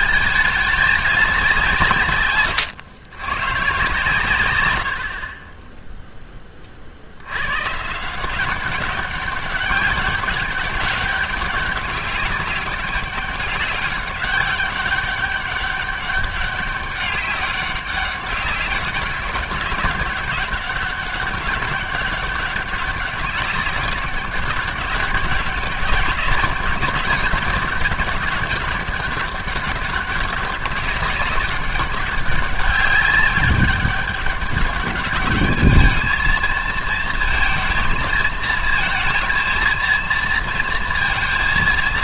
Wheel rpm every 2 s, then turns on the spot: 220, 110, 90, 20, 180, 200, 200, 200, 200, 200, 190, 200, 200, 200, 200, 200, 200, 200, 220, 230, 230.
none